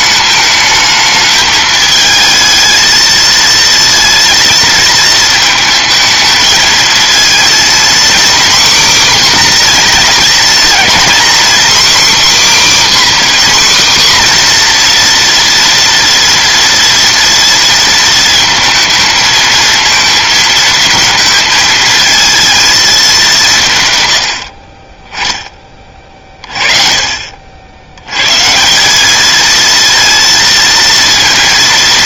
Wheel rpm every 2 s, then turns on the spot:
220, 220, 220, 230, 260, 240, 280, 240, 230, 220, 220, 210, 20, 30, 170, 230.
none